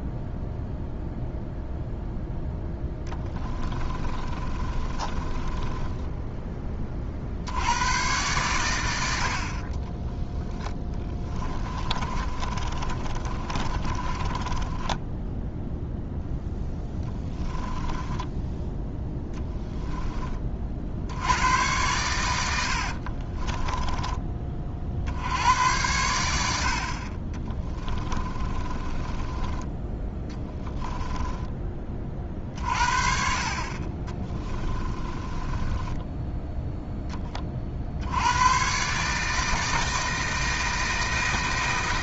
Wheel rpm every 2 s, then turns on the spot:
0, 10, 30, 20, 100, 20, 30, 20, 10, 10, 50, 80, 50, 50, 30, 10, 40, 20, 10, 130, 160.
2-6 10-18 22-24 28-32 34-36